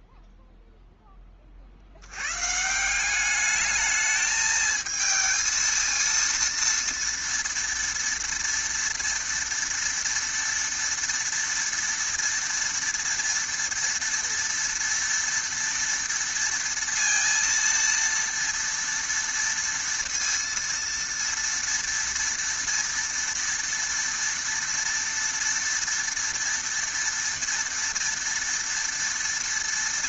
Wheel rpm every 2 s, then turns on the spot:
0, 150, 220, 230, 230, 230, 230, 230, 230, 230, 230, 230, 230, 230, 230.
none